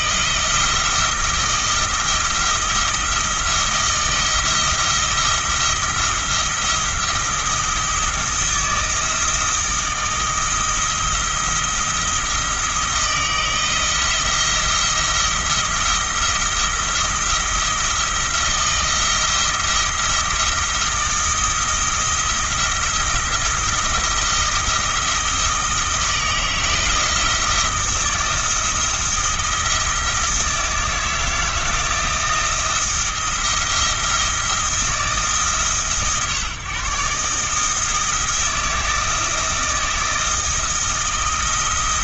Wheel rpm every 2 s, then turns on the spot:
170, 170, 170, 170, 160, 170, 160, 170, 170, 170, 170, 170, 170, 160, 160, 160, 170, 160, 140, 170, 170.
none